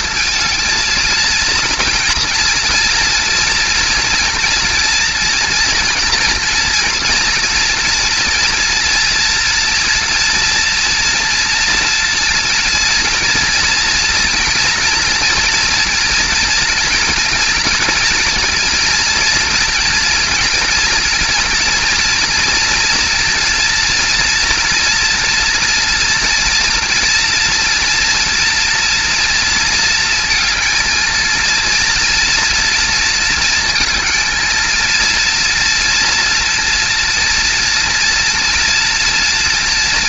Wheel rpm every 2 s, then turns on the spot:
230, 230, 240, 230, 230, 230, 230, 230, 230, 230, 240, 230, 230, 240, 240, 220, 230, 220, 230, 230.
none